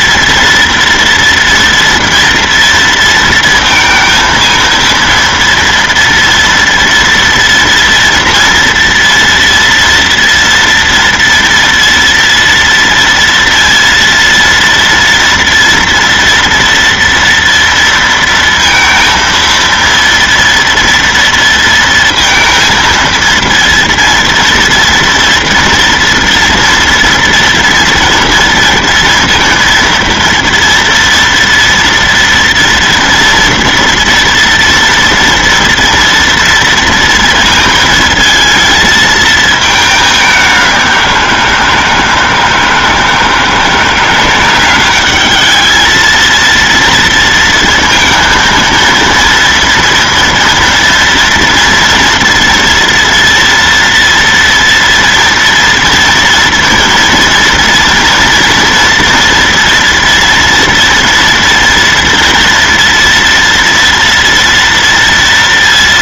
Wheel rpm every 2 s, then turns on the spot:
230, 230, 230, 230, 230, 230, 230, 230, 230, 230, 230, 230, 230, 230, 230, 230, 240, 230, 230, 220, 180, 160, 200, 230, 230, 230, 230, 230, 230, 230, 230, 230, 230.
none